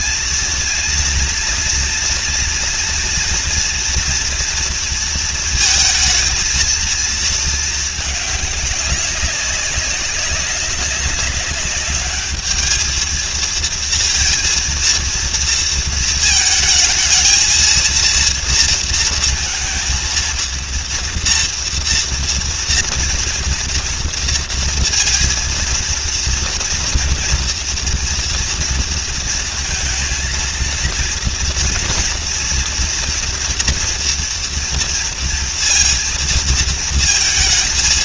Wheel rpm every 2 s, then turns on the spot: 230, 230, 230, 230, 200, 200, 220, 230, 220, 230, 230, 230, 230, 230, 230, 230, 230, 230, 230.
none